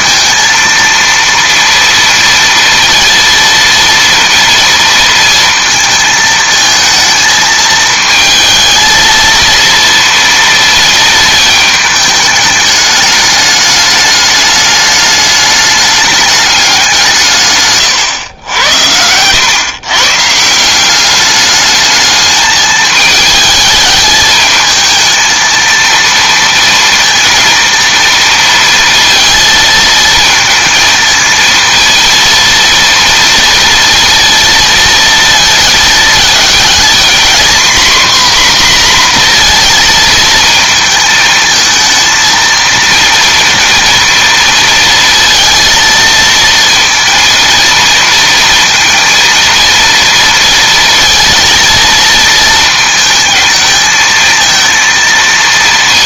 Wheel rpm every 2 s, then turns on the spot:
230, 230, 230, 230, 220, 230, 210, 210, 200, 90, 170, 210, 220, 230, 230, 220, 230, 230, 230, 250, 220, 230, 230, 230, 230, 230, 230, 230.
none